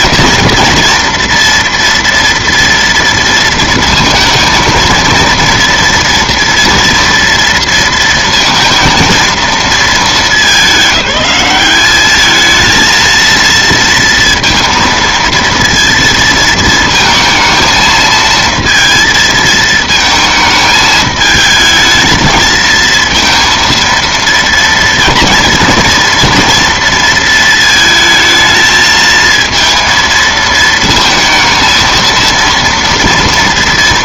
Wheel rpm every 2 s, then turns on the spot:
230, 230, 230, 240, 230, 200, 220, 230, 230, 230, 220, 230, 230, 230, 220, 220, 230.
none